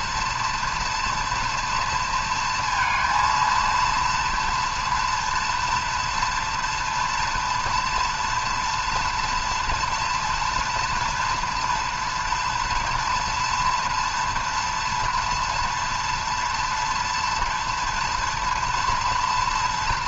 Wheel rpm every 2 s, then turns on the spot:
230, 230, 230, 240, 230, 230, 240, 230, 230, 230.
none